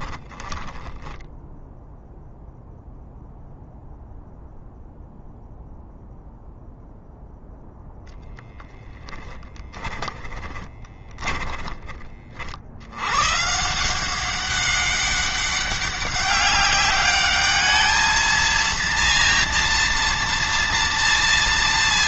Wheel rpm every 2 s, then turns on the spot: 10, 0, 0, 0, 0, 20, 70, 200, 200, 230, 230.
0-2 10-12